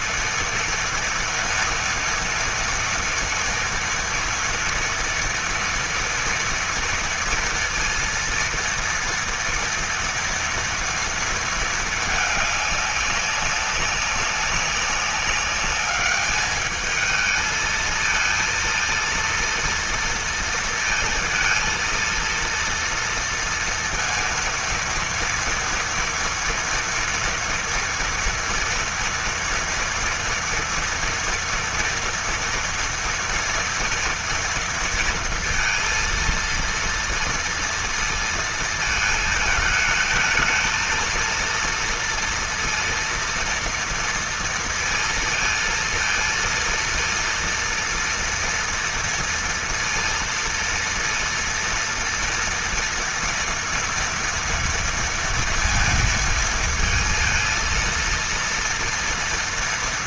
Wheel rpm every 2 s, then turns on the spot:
230, 230, 240, 230, 230, 230, 200, 200, 220, 230, 230, 230, 230, 230, 230, 230, 230, 230, 230, 220, 230, 230, 230, 230, 240, 230, 230, 230, 230, 230.
none